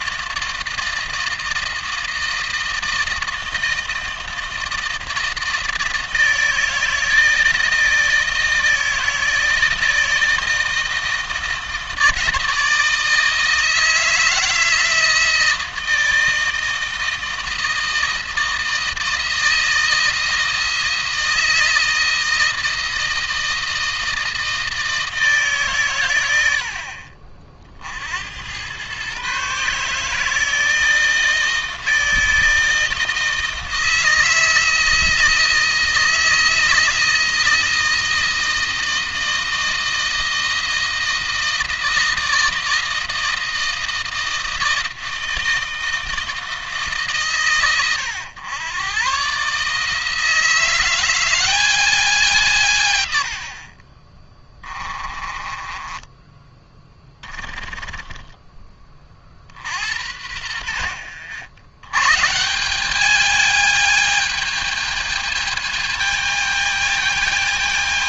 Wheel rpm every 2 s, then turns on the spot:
160, 160, 160, 160, 160, 160, 160, 160, 160, 160, 160, 160, 160, 70, 110, 160, 160, 160, 160, 160, 160, 160, 160, 140, 110, 170, 130, 20, 10, 30, 80, 200, 220, 210.
54-56